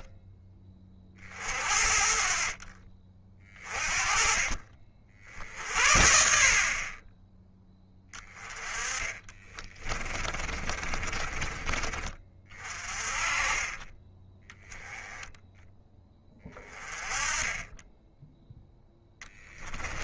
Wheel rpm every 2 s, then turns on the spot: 30, 40, 40, 30, 20, 30, 30, 20, 20, 10.
8-12 18-20